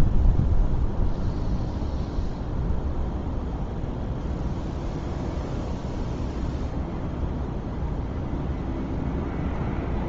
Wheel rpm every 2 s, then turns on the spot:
0, 0, 0, 0, 0.
none